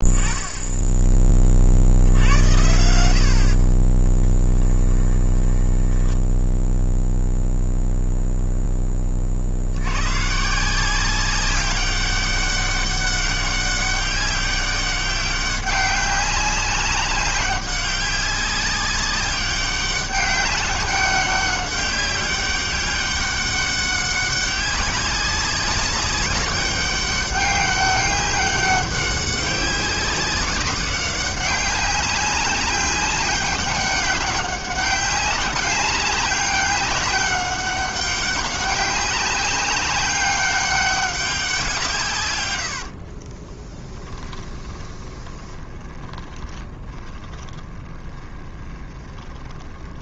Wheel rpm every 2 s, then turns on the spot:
10, 80, 20, 0, 10, 180, 200, 190, 200, 200, 200, 190, 200, 200, 190, 190, 200, 190, 200, 190, 190, 70, 20, 20, 20.
4-6 42-50